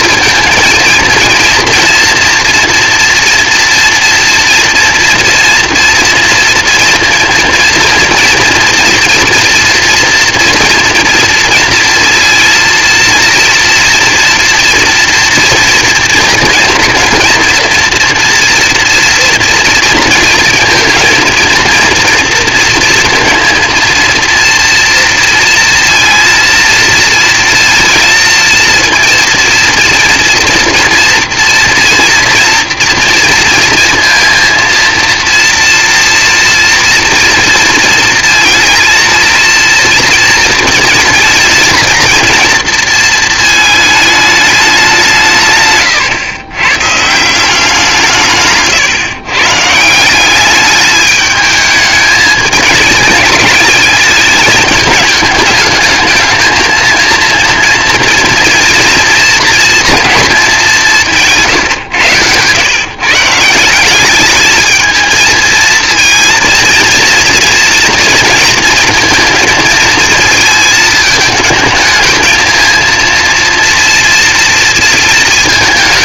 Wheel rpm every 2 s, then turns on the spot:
220, 230, 230, 230, 240, 230, 230, 230, 240, 230, 220, 230, 230, 220, 230, 230, 230, 230, 240, 230, 220, 230, 200, 120, 140, 210, 220, 210, 220, 230, 210, 130, 220, 230, 230, 220, 220, 230.
48-50